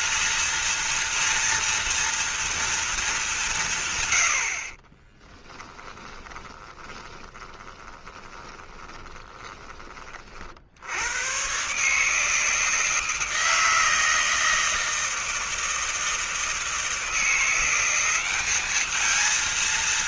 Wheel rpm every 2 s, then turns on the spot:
230, 230, 40, 20, 20, 60, 160, 160, 160, 210.
6-10